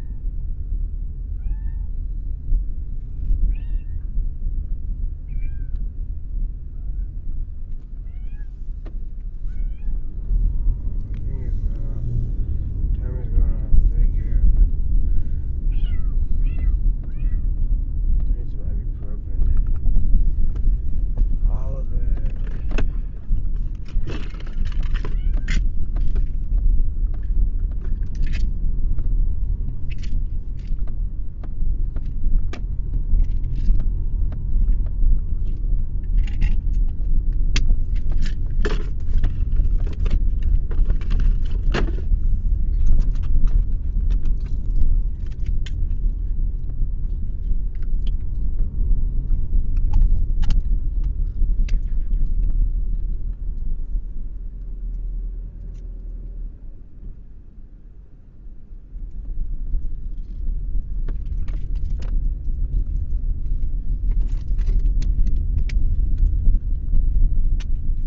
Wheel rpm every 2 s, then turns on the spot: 0, 0, 0, 0, 0, 0, 0, 0, 0, 0, 0, 0, 0, 0, 0, 0, 0, 0, 0, 0, 0, 0, 0, 0, 0, 0, 0, 0, 0, 0, 0, 0, 0, 0.
none